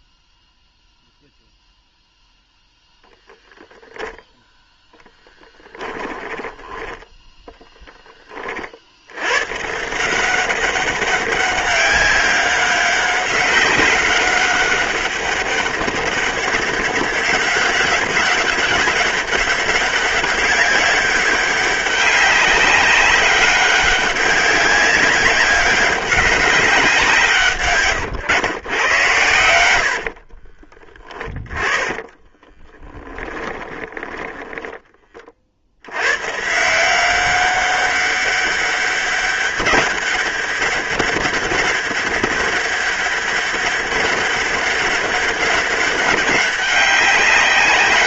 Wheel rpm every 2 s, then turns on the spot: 0, 10, 0, 10, 80, 190, 200, 200, 190, 200, 200, 200, 190, 170, 100, 30, 10, 30, 180, 200, 200, 200, 200, 190.
6-8 32-34